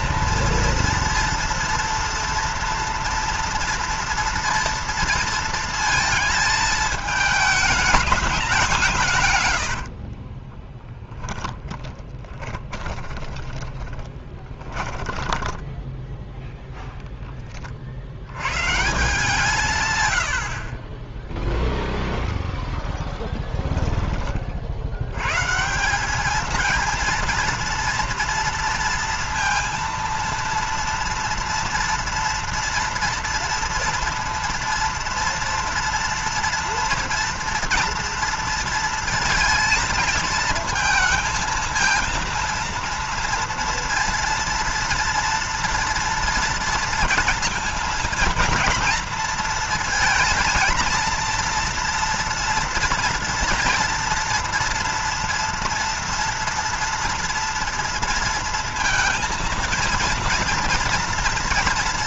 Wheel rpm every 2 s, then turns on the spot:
230, 230, 230, 220, 180, 10, 20, 20, 0, 150, 40, 0, 60, 220, 230, 230, 230, 230, 230, 230, 220, 230, 230, 230, 230, 230, 230, 230, 230, 230, 230.
10-16 20-22